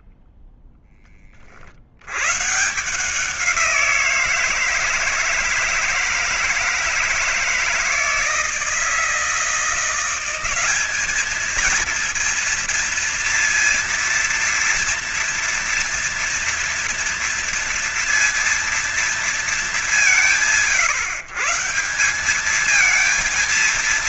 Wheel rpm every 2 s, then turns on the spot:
10, 150, 170, 160, 160, 200, 230, 230, 240, 230, 150, 220.
none